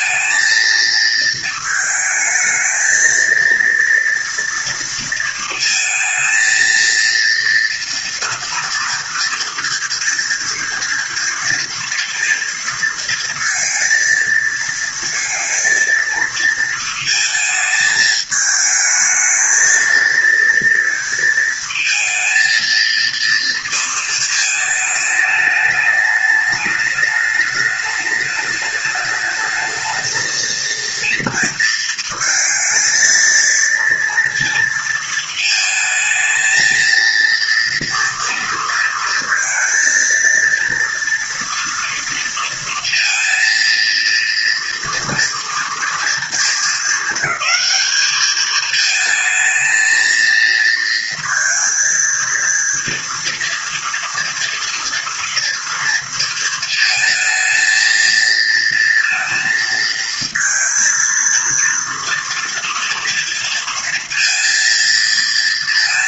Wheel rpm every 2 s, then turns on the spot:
220, 220, 230, 230, 230, 230, 230, 230, 230, 220, 230, 230, 210, 210, 210, 230, 230, 230, 230, 230, 230, 230, 230, 220, 220, 230, 230, 230, 220, 230, 230, 230, 230.
none